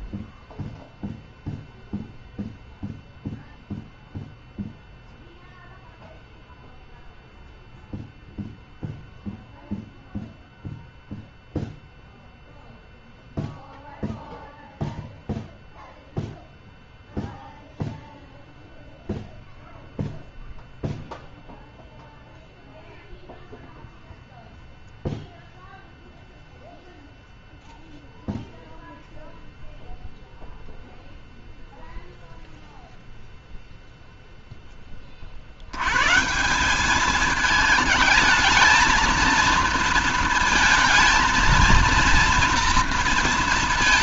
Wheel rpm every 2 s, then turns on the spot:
0, 0, 0, 0, 0, 0, 0, 0, 0, 0, 0, 0, 0, 0, 0, 0, 0, 20, 190, 220, 230, 230.
none